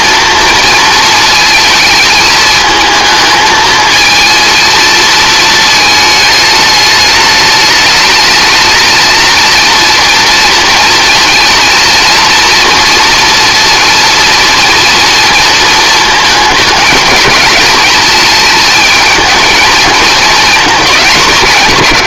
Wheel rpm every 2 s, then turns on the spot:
230, 220, 230, 210, 220, 230, 230, 230, 210, 220, 200.
none